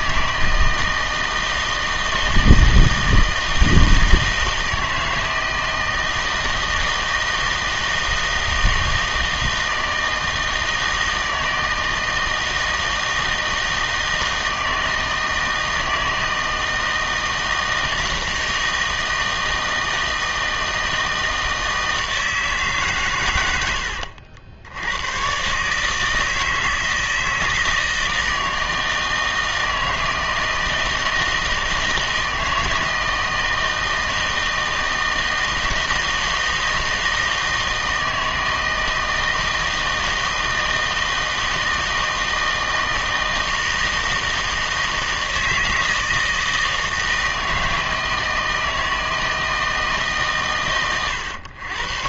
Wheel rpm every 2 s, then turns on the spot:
160, 160, 160, 160, 160, 160, 160, 160, 160, 160, 160, 150, 80, 160, 160, 160, 160, 160, 160, 160, 160, 160, 160, 160, 160, 120.
none